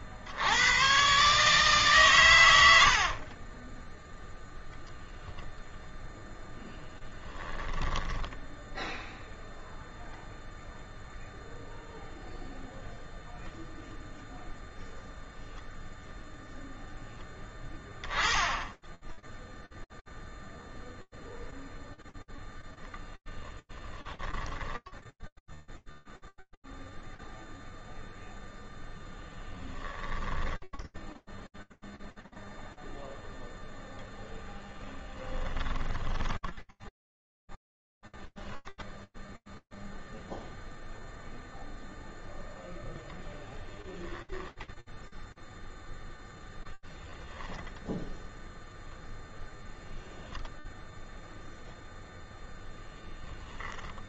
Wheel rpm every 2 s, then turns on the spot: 70, 110, 0, 0, 0, 0, 0, 0, 0, 10, 0, 0, 10, 0, 0, 10, 0, 0, 20, 0, 0, 0, 10, 0, 0, 0, 10.
24-26 36-38 52-54